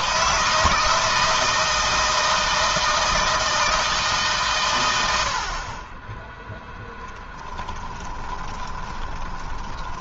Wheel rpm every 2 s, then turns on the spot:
160, 160, 100, 10, 20.
6-10